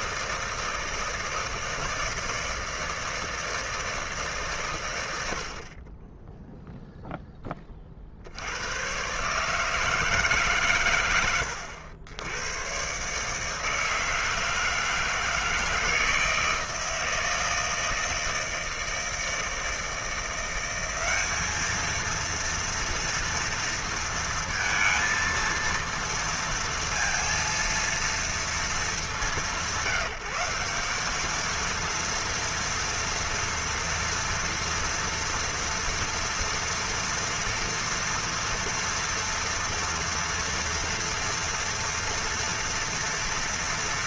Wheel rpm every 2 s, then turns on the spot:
160, 160, 150, 10, 90, 150, 100, 160, 160, 160, 180, 230, 220, 230, 220, 180, 230, 240, 230, 240, 230, 230.
none